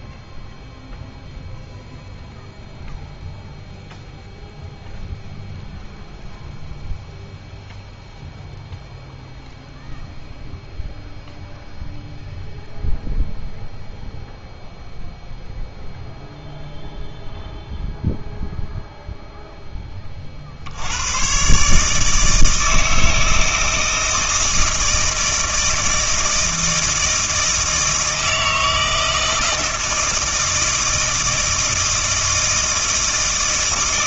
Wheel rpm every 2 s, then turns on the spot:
0, 0, 0, 0, 0, 0, 0, 0, 0, 0, 90, 160, 160, 160, 160, 160, 160.
none